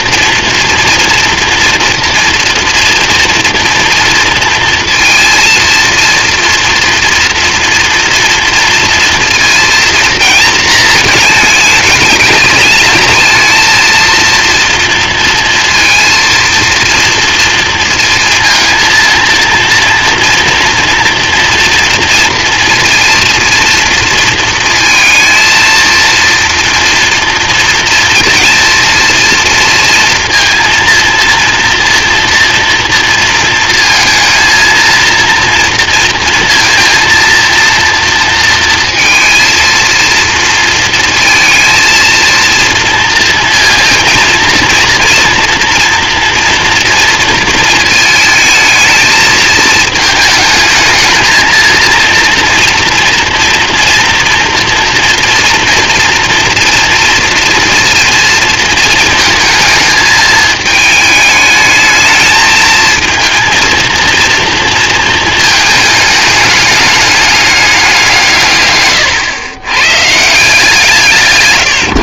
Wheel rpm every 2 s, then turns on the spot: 230, 230, 230, 230, 230, 220, 220, 230, 230, 230, 240, 230, 230, 230, 230, 230, 230, 230, 230, 230, 230, 230, 230, 230, 220, 220, 230, 240, 230, 220, 220, 230, 230, 210, 120, 170.
none